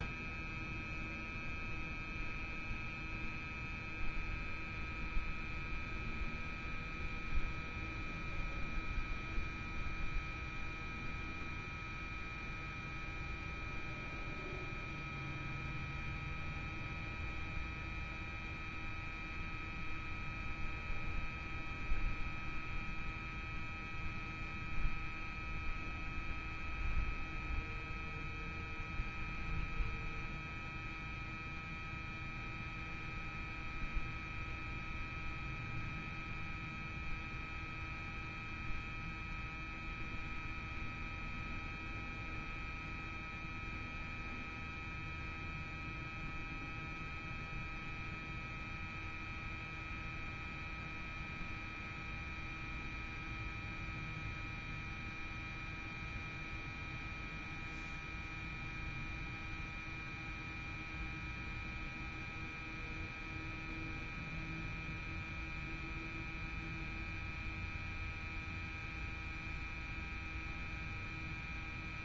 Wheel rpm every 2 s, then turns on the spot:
0, 0, 0, 0, 0, 0, 0, 0, 0, 0, 0, 0, 0, 0, 0, 0, 0, 0, 0, 0, 0, 0, 0, 0, 0, 0, 0, 0, 0, 0, 0, 0, 0, 0, 0, 0.
none